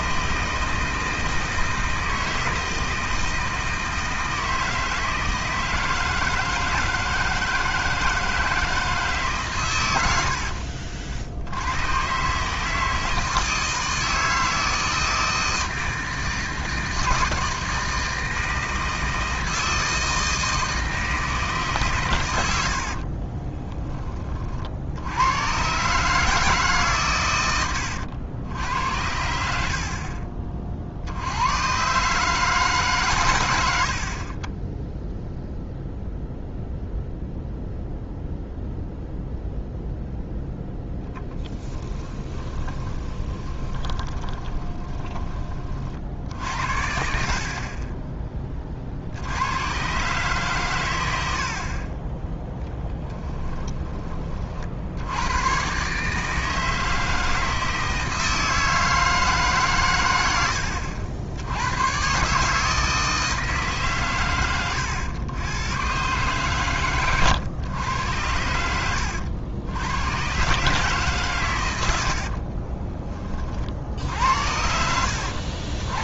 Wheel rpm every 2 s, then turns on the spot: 160, 160, 160, 160, 160, 60, 160, 160, 160, 160, 160, 70, 60, 130, 80, 50, 140, 10, 0, 0, 0, 20, 20, 70, 50, 120, 0, 60, 160, 160, 70, 160, 110, 120, 90, 140, 30, 80.
22-24 42-46 72-74